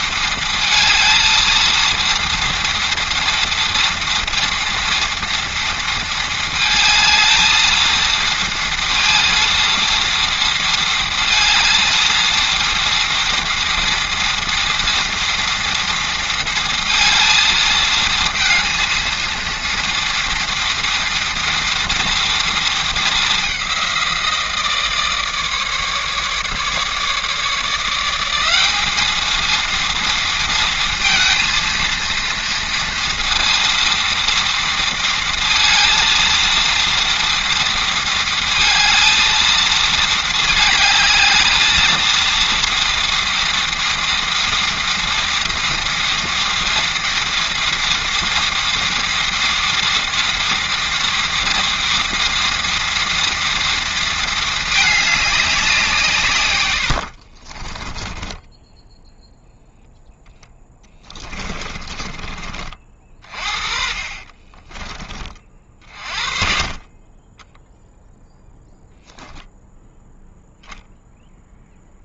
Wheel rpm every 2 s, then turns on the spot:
230, 230, 230, 220, 230, 230, 230, 230, 230, 230, 230, 210, 150, 150, 220, 230, 230, 230, 230, 230, 210, 230, 230, 230, 230, 240, 230, 200, 60, 0, 20, 40, 30, 30, 0, 0.
56-58 60-64